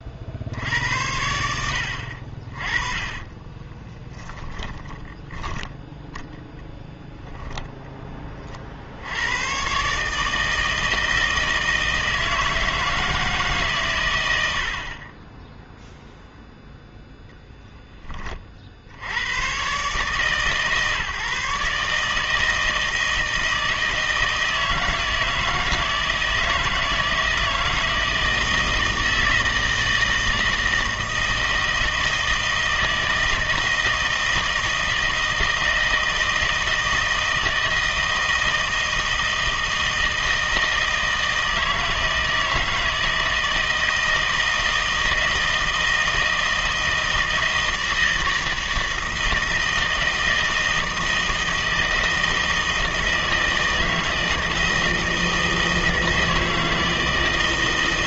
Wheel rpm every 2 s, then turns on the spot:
70, 30, 10, 0, 40, 160, 160, 60, 0, 50, 150, 160, 160, 160, 160, 160, 160, 160, 160, 160, 160, 160, 160, 160, 160, 160, 160, 160, 160.
2-6